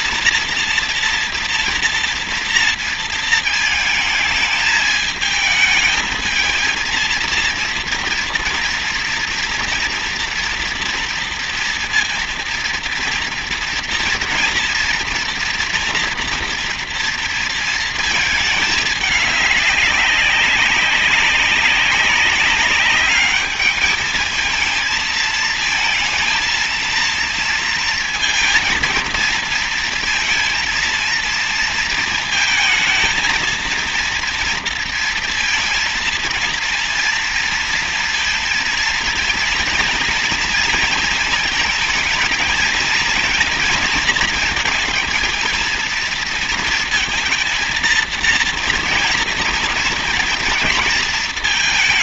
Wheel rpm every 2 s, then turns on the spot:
230, 230, 220, 220, 230, 240, 230, 230, 230, 220, 190, 190, 220, 230, 220, 230, 230, 230, 230, 230, 230, 220, 230, 230, 230, 230.
none